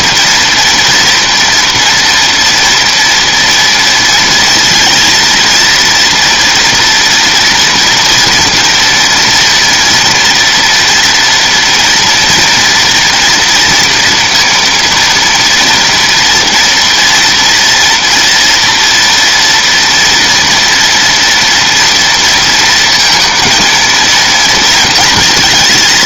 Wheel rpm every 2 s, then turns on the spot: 240, 230, 230, 230, 230, 240, 230, 230, 240, 230, 240, 230, 230.
none